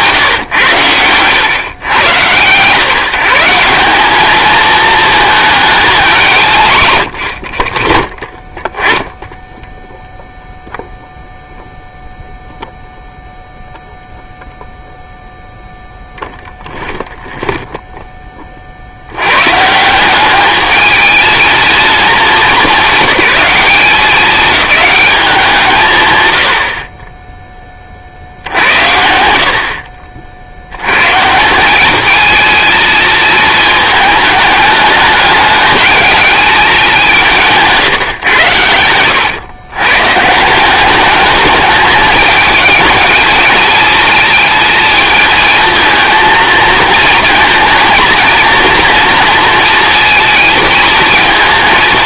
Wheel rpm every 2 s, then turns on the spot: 120, 150, 220, 140, 10, 0, 0, 0, 0, 50, 210, 210, 210, 60, 90, 70, 230, 210, 200, 100, 170, 220, 220, 230, 230, 230.
none